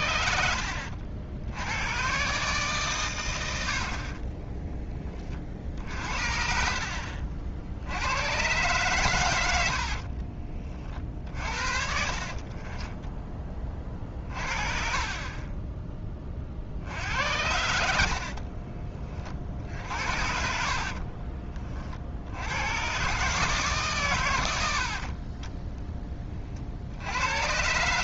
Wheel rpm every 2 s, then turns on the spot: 70, 130, 10, 60, 120, 40, 30, 40, 60, 30, 50, 100, 80, 50.
0-2 12-16 18-22